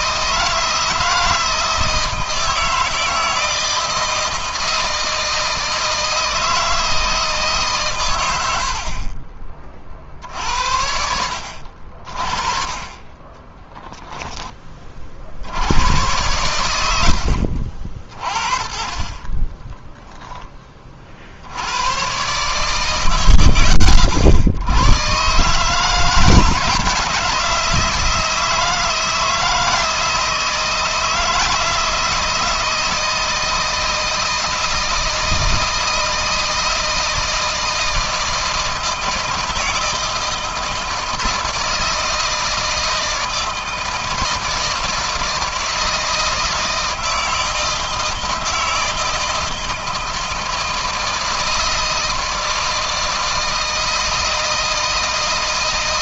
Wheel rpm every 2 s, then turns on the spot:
160, 160, 160, 160, 50, 70, 40, 40, 100, 30, 30, 120, 120, 170, 160, 160, 160, 160, 160, 160, 160, 160, 160, 160, 160, 160, 160, 160.
8-10 12-14 16-18